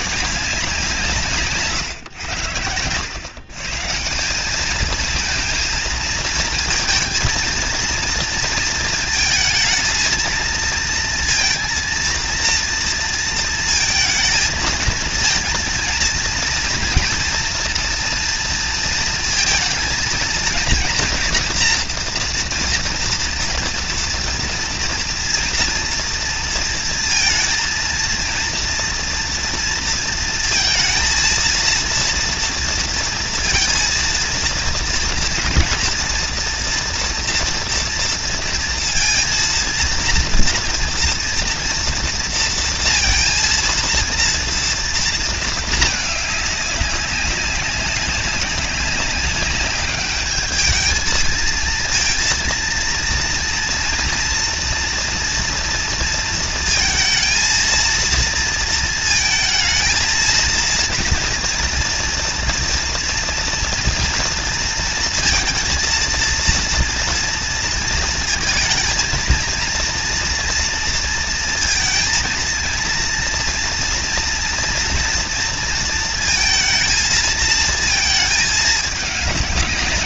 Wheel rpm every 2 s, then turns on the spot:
170, 100, 220, 230, 230, 230, 230, 230, 230, 230, 230, 230, 230, 230, 230, 230, 230, 230, 230, 230, 230, 230, 230, 200, 190, 210, 230, 230, 230, 230, 230, 230, 230, 230, 230, 230, 230, 230, 230, 220.
none